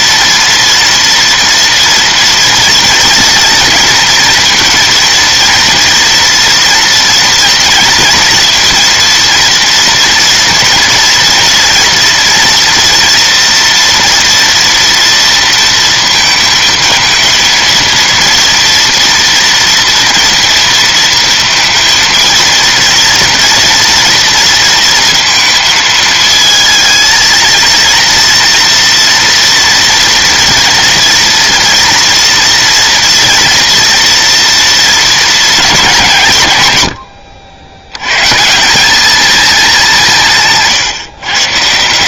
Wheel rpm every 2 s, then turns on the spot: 230, 240, 230, 230, 230, 240, 230, 230, 230, 230, 230, 230, 230, 230, 230, 240, 240, 230, 120, 190, 150.
none